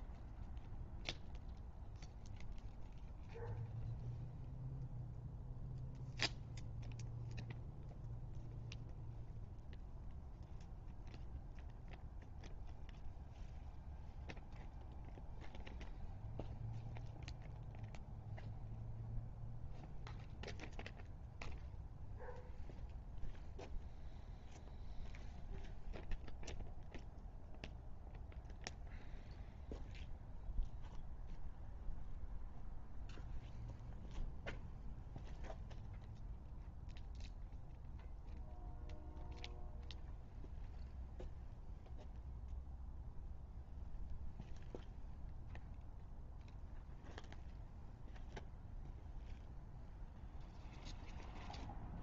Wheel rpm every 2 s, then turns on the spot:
0, 0, 0, 0, 0, 0, 0, 0, 0, 0, 0, 0, 0, 0, 0, 0, 0, 0, 0, 0, 0, 0, 0, 0, 0, 0.
none